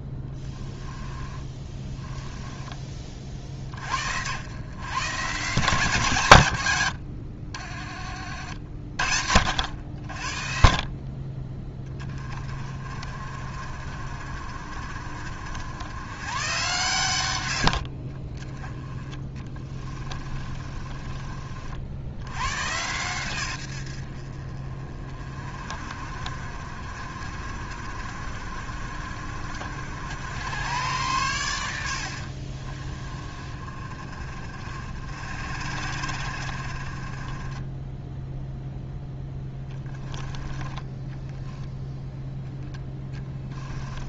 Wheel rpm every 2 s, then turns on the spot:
10, 30, 130, 90, 50, 40, 40, 50, 120, 20, 30, 120, 40, 50, 50, 100, 40, 50, 40, 0, 10, 10.
0-2 18-22 40-42